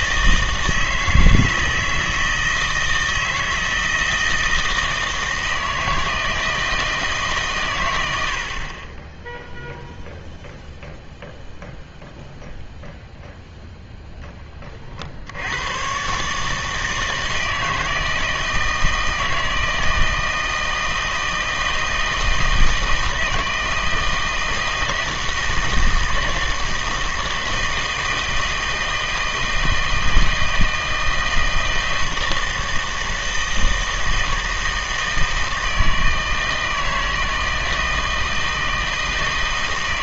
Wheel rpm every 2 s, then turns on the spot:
160, 160, 160, 160, 40, 0, 0, 30, 150, 160, 160, 160, 160, 160, 160, 160, 160, 160, 160, 160.
none